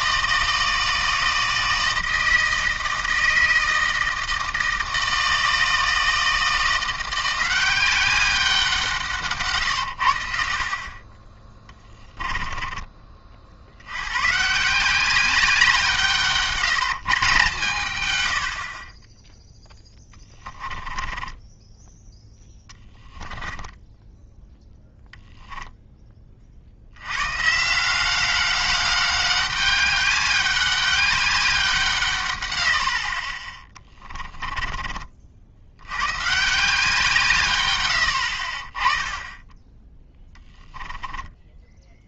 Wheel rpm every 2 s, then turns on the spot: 160, 160, 160, 170, 170, 40, 20, 170, 160, 50, 10, 10, 0, 70, 200, 200, 80, 30, 160, 20, 10.
12-14 20-24 34-36